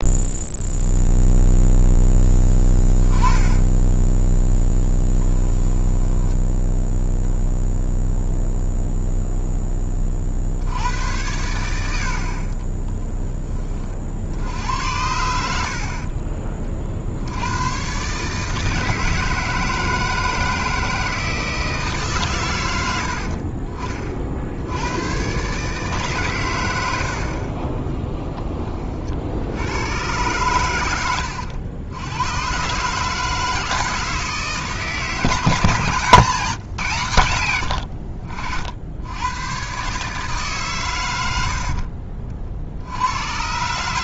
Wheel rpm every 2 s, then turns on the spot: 0, 10, 10, 0, 0, 70, 30, 90, 40, 160, 160, 100, 80, 110, 30, 100, 130, 160, 150, 70, 140, 60.
2-4 12-14